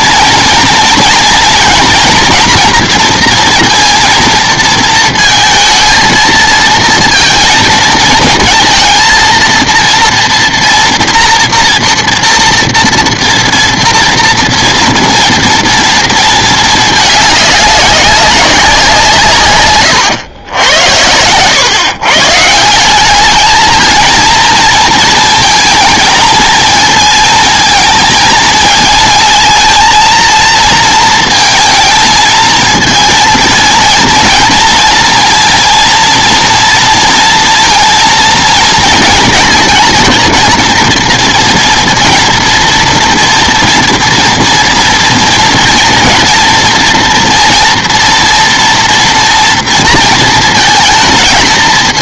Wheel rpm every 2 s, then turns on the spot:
230, 240, 230, 230, 220, 240, 230, 240, 220, 190, 90, 180, 230, 220, 230, 230, 220, 230, 230, 230, 230, 240, 230, 230, 230, 220.
none